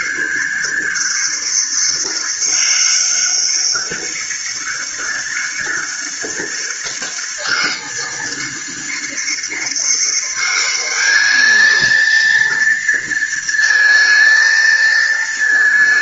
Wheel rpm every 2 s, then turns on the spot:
190, 200, 200, 200, 200, 200, 230, 220.
none